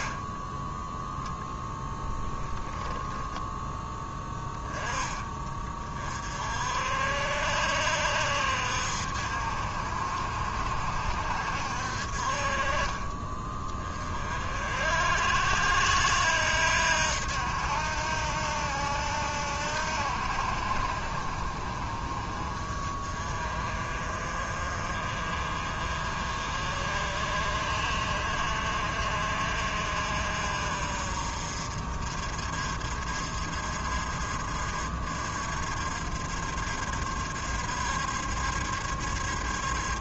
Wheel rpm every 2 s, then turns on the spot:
0, 10, 20, 60, 60, 70, 30, 60, 80, 80, 60, 40, 40, 40, 50, 50, 50, 60, 60, 70.
none